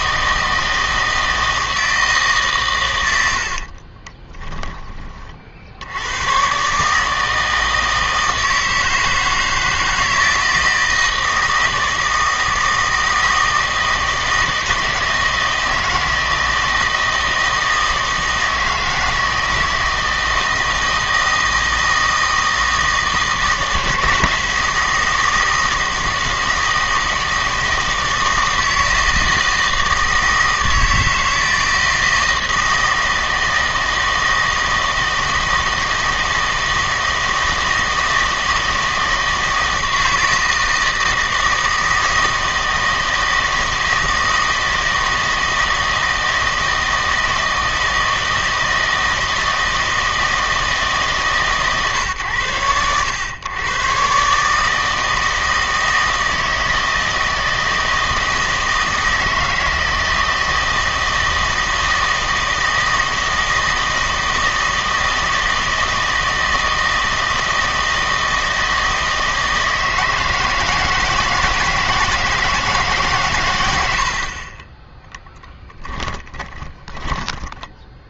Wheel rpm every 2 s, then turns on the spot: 160, 130, 20, 140, 160, 160, 160, 160, 160, 160, 160, 160, 160, 160, 160, 160, 160, 160, 160, 160, 160, 160, 160, 160, 160, 160, 110, 150, 160, 160, 160, 160, 160, 160, 160, 160, 160, 20, 20.
76-78